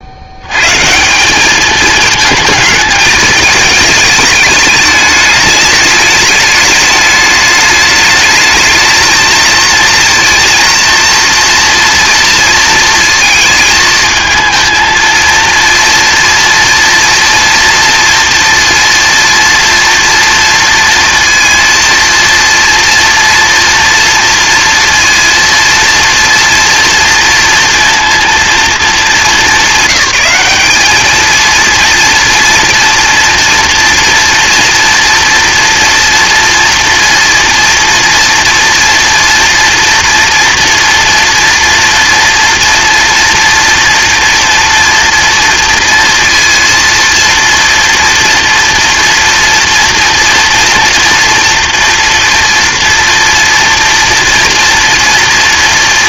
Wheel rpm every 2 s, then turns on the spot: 130, 220, 210, 220, 220, 230, 230, 220, 230, 230, 230, 230, 230, 230, 220, 210, 230, 230, 230, 230, 230, 240, 230, 230, 230, 230, 230, 240.
none